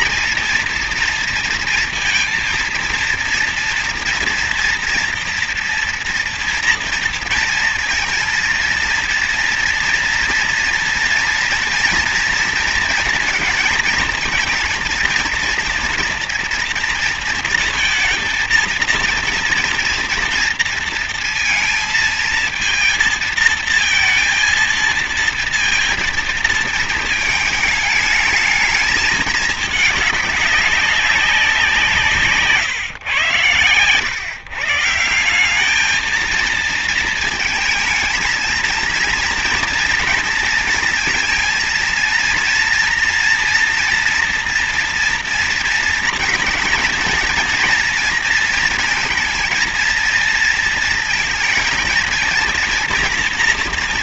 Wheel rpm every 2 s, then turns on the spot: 230, 230, 230, 230, 230, 230, 230, 230, 230, 230, 230, 230, 230, 220, 220, 200, 140, 150, 230, 230, 230, 230, 230, 230, 230, 230, 230.
none